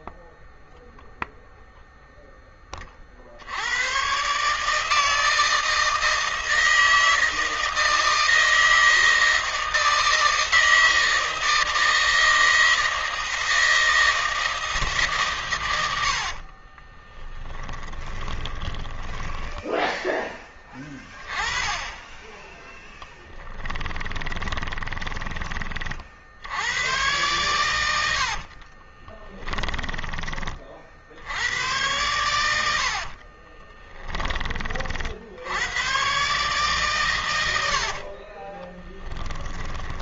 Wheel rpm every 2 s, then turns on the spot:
0, 50, 160, 160, 160, 160, 160, 150, 10, 10, 10, 10, 20, 100, 20, 70, 60, 60, 120, 10.
16-20 22-24 28-30 32-34 38-40